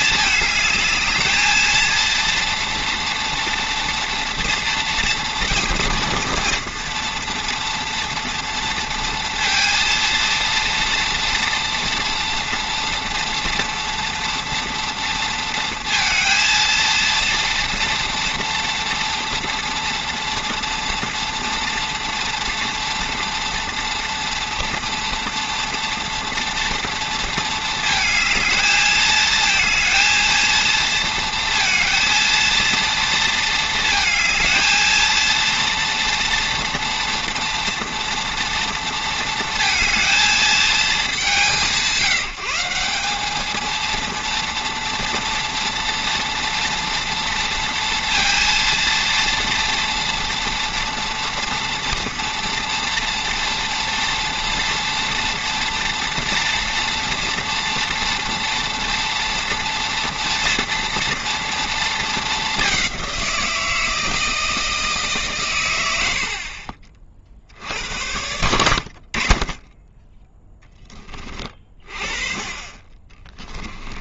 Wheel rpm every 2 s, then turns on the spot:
220, 230, 230, 230, 230, 230, 230, 230, 230, 230, 230, 230, 230, 230, 220, 230, 230, 230, 230, 230, 200, 180, 230, 230, 230, 230, 230, 230, 240, 240, 230, 190, 160, 40, 40, 10, 30.
none